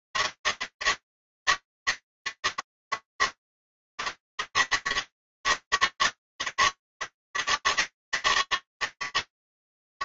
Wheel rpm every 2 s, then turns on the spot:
160, 150, 140, 140, 150.
none